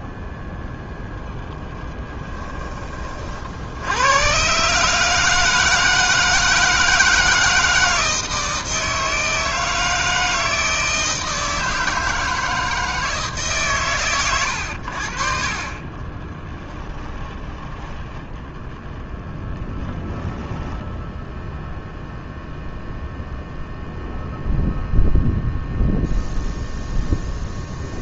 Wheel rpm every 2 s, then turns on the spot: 0, 30, 150, 160, 160, 160, 160, 50, 10, 0, 10, 0, 0, 0.
16-18 20-22